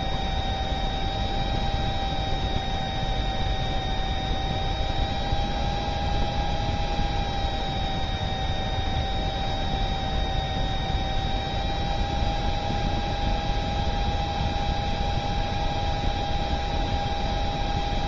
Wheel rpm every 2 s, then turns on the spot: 0, 0, 0, 0, 0, 0, 0, 0, 0.
none